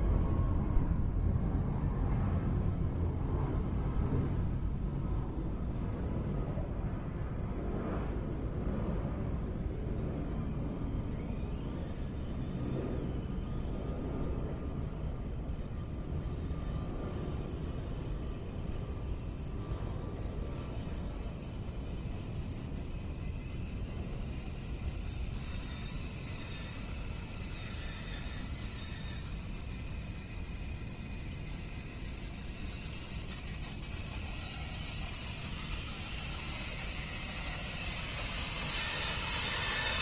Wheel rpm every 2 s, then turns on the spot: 0, 0, 0, 0, 0, 0, 0, 0, 0, 0, 0, 0, 0, 0, 0, 0, 0, 0, 0, 0.
none